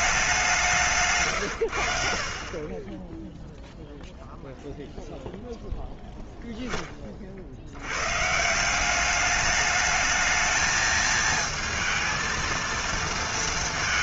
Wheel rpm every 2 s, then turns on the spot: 190, 30, 0, 10, 170, 220, 230.
none